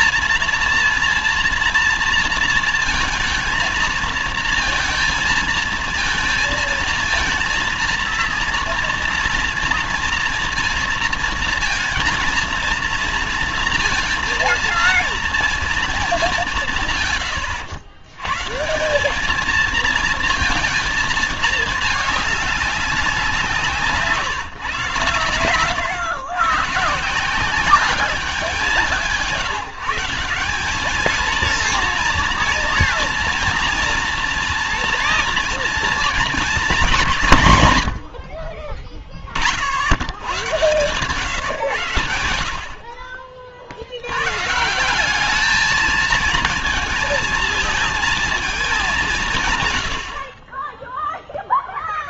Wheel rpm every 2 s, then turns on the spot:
240, 230, 230, 230, 230, 230, 230, 230, 180, 140, 230, 200, 140, 130, 190, 190, 240, 240, 230, 40, 100, 70, 130, 220, 220, 40.
none